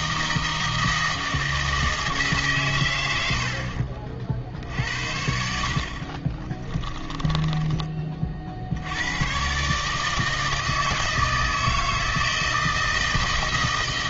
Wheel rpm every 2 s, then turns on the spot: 160, 130, 60, 20, 60, 160, 160.
6-8